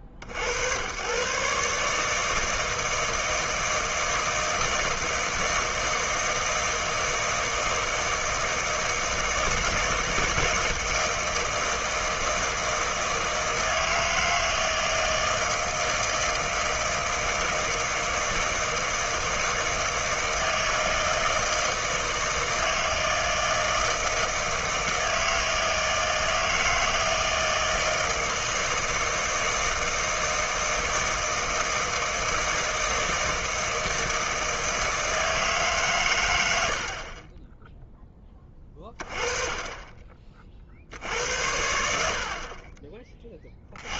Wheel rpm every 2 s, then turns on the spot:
50, 160, 160, 160, 160, 160, 160, 160, 160, 160, 160, 160, 160, 160, 160, 160, 160, 160, 90, 20, 40, 40.
none